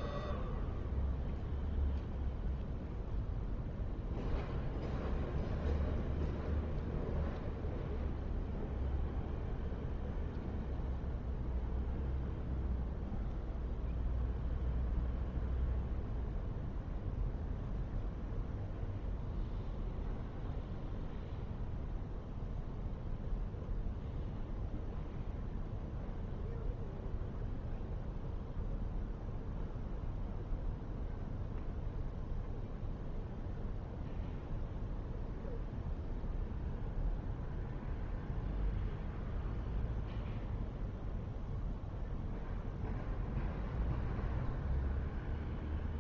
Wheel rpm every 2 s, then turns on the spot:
0, 0, 0, 0, 0, 0, 0, 0, 0, 0, 0, 0, 0, 0, 0, 0, 0, 0, 0, 0, 0, 0, 0.
none